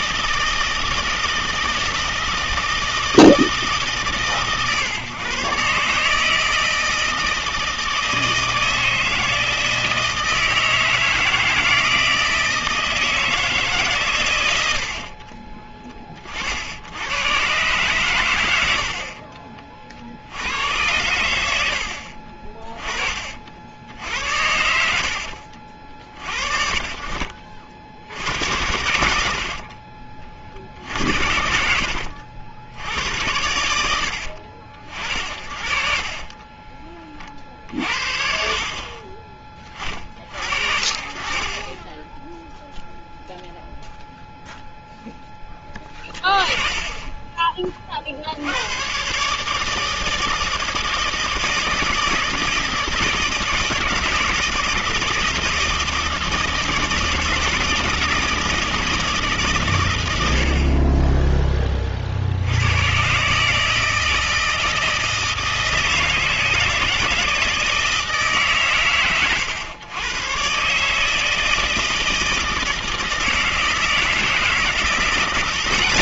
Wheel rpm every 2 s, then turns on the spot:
160, 160, 130, 160, 160, 160, 160, 90, 70, 90, 90, 30, 70, 50, 90, 50, 70, 60, 20, 50, 50, 0, 0, 30, 90, 160, 160, 160, 160, 160, 60, 90, 160, 160, 120, 140, 160, 160.
24-26 36-38